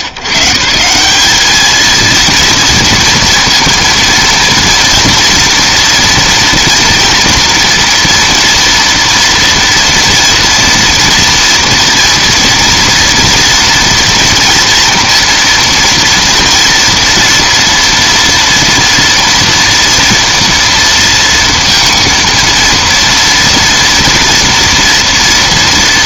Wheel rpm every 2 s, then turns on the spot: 130, 230, 230, 230, 230, 230, 230, 230, 230, 230, 230, 230, 230.
none